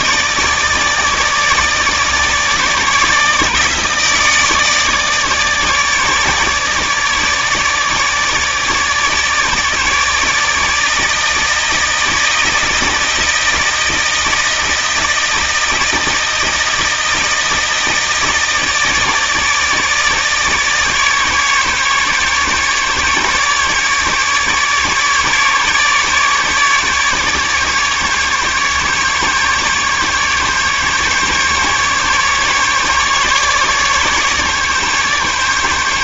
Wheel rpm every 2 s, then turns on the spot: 160, 150, 150, 150, 150, 150, 160, 160, 160, 160, 150, 150, 150, 150, 150, 140, 150, 140.
none